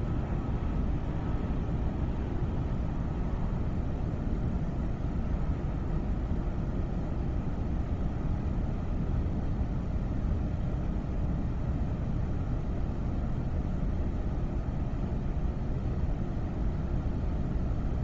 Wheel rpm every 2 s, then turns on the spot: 0, 0, 0, 0, 0, 0, 0, 0, 0.
none